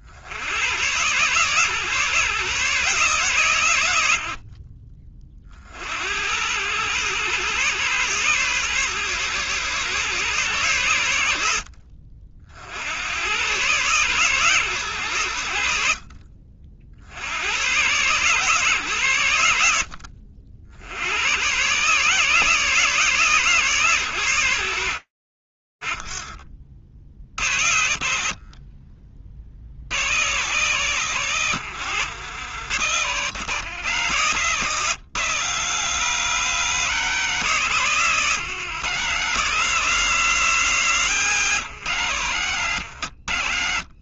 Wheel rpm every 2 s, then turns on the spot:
120, 140, 30, 120, 120, 100, 90, 100, 60, 120, 80, 150, 50, 70, 70, 100, 120, 140, 130, 150, 130, 40.
none